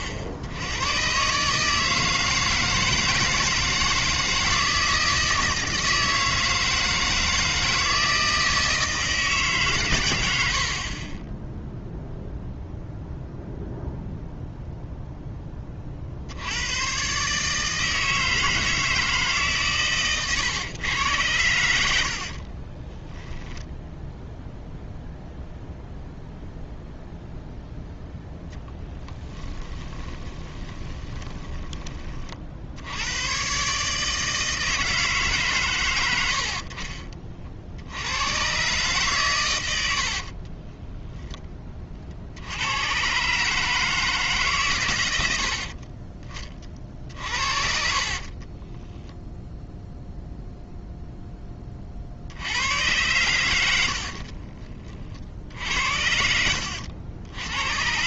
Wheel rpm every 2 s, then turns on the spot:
80, 160, 160, 160, 160, 70, 0, 0, 100, 160, 110, 40, 0, 0, 10, 20, 70, 160, 60, 130, 30, 90, 130, 40, 20, 0, 90, 50, 80.
22-24 28-32 36-38 40-42 48-50 54-58